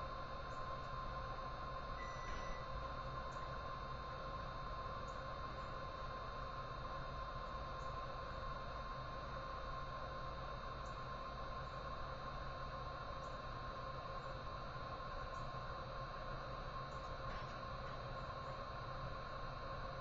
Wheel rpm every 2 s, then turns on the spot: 0, 0, 0, 0, 0, 0, 0, 0, 0, 0.
none